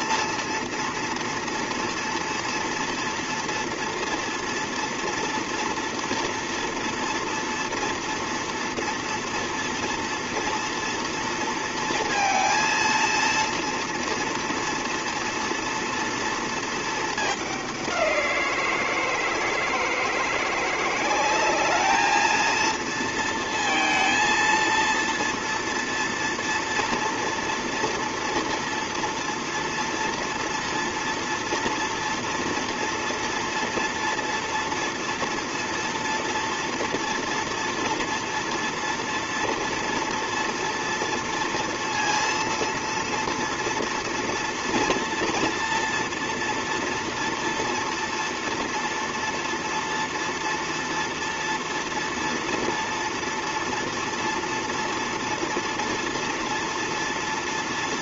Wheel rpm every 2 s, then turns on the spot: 230, 230, 230, 230, 230, 230, 230, 230, 230, 170, 170, 230, 230, 230, 230, 230, 230, 230, 230, 230, 230, 230, 230, 240, 230, 230, 230, 230, 230.
none